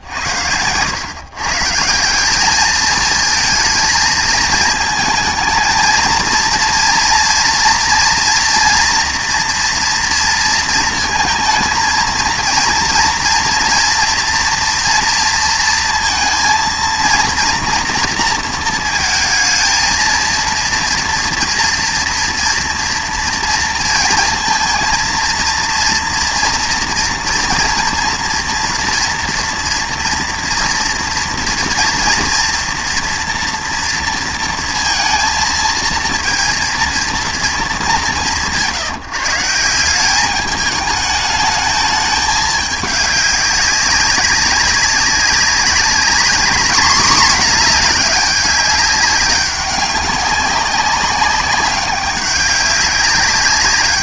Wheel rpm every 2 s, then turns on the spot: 100, 220, 220, 230, 230, 230, 230, 230, 230, 230, 230, 240, 230, 240, 230, 230, 230, 230, 230, 160, 210, 210, 200, 220, 200, 190, 200.
none